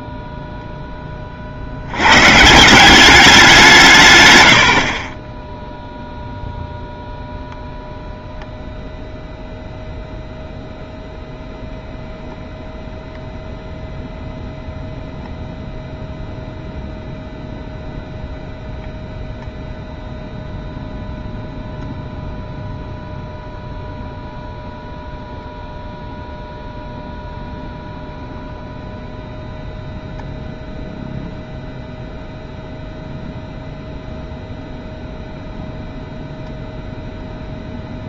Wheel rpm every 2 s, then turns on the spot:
10, 190, 60, 0, 0, 0, 0, 0, 0, 0, 0, 0, 0, 0, 0, 0, 0, 0, 0.
none